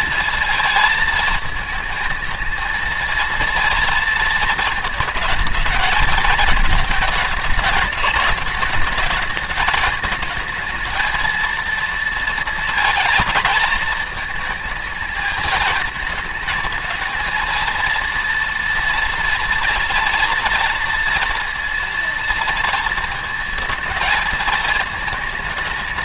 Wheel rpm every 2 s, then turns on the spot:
230, 230, 220, 220, 210, 220, 230, 220, 220, 230, 230, 230, 220.
none